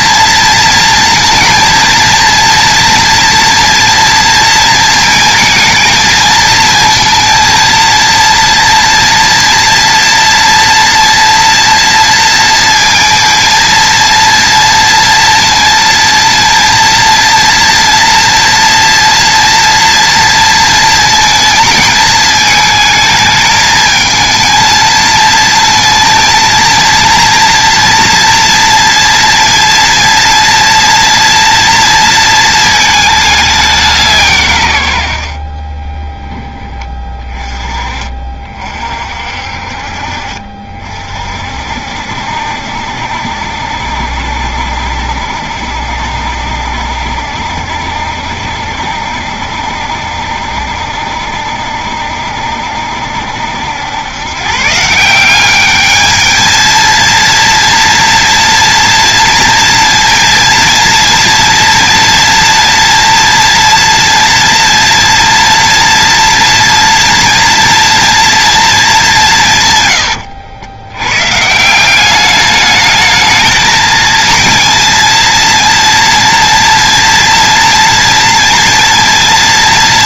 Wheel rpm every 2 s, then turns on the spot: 230, 230, 230, 220, 230, 230, 230, 230, 230, 230, 230, 220, 220, 230, 230, 230, 220, 110, 10, 50, 50, 70, 70, 70, 70, 70, 70, 160, 230, 230, 230, 230, 230, 230, 220, 100, 210, 230, 230, 230.
none